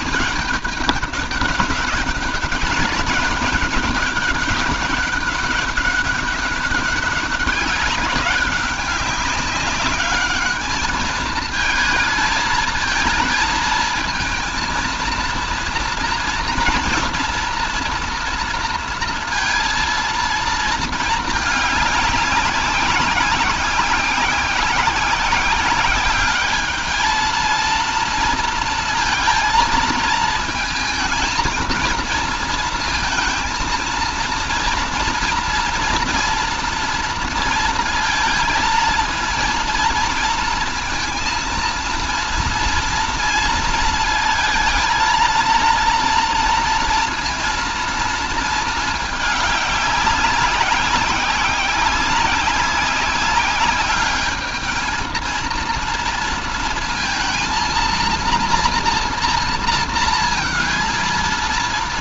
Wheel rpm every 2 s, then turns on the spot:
210, 200, 200, 190, 200, 210, 220, 230, 230, 230, 220, 190, 190, 210, 230, 220, 230, 230, 230, 230, 230, 230, 220, 230, 220, 190, 190, 220, 230, 240, 230.
none